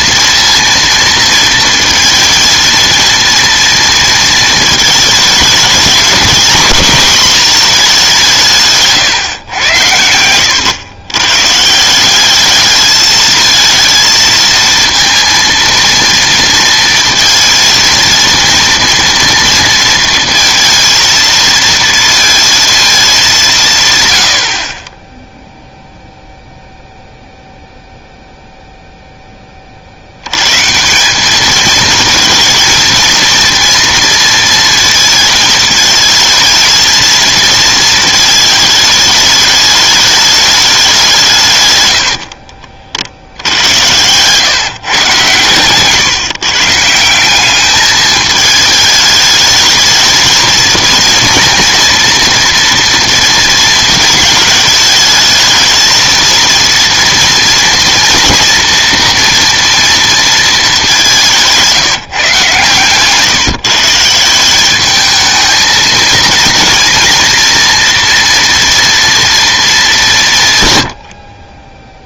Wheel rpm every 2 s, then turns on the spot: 230, 230, 220, 220, 160, 110, 210, 230, 230, 230, 230, 220, 50, 0, 0, 150, 220, 230, 220, 210, 200, 60, 140, 150, 210, 230, 230, 220, 230, 240, 210, 130, 200, 230, 240, 120.
none